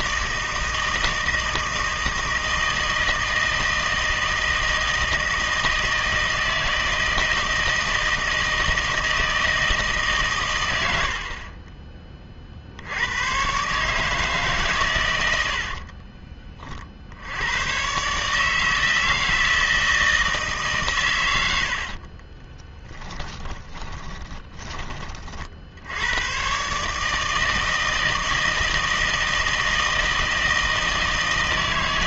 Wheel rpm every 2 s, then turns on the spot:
160, 160, 160, 160, 160, 100, 60, 130, 40, 160, 140, 10, 20, 140, 160, 160.
22-24